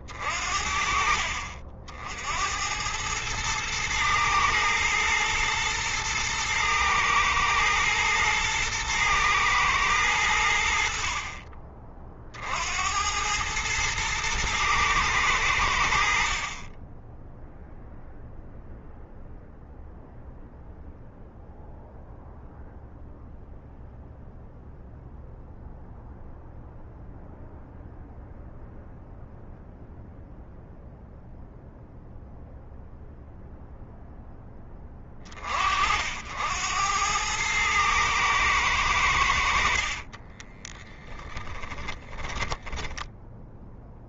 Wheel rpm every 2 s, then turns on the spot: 40, 100, 110, 110, 110, 70, 80, 110, 10, 0, 0, 0, 0, 0, 0, 0, 0, 20, 100, 90, 10, 10.
40-44